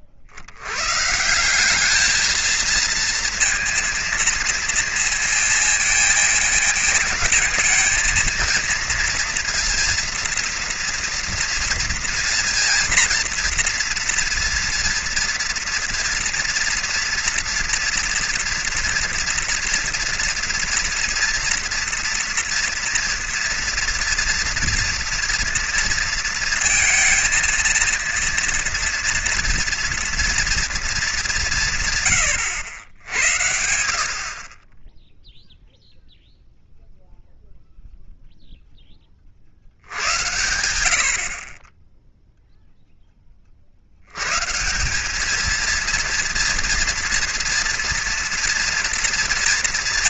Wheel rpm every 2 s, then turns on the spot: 80, 220, 230, 230, 230, 230, 230, 230, 230, 230, 230, 230, 230, 220, 230, 230, 90, 20, 0, 20, 80, 0, 160, 230, 230.
none